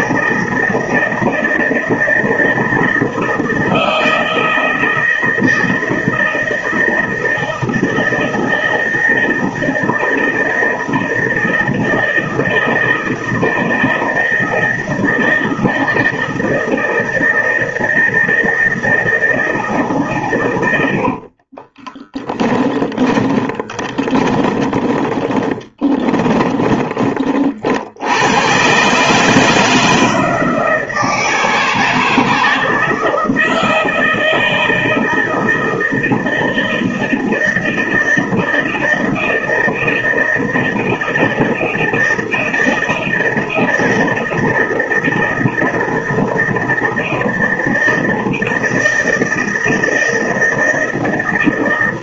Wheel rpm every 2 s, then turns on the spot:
160, 160, 160, 160, 160, 160, 160, 160, 160, 160, 110, 20, 30, 20, 110, 160, 160, 160, 170, 160, 160, 160, 160, 160, 160, 160.
22-28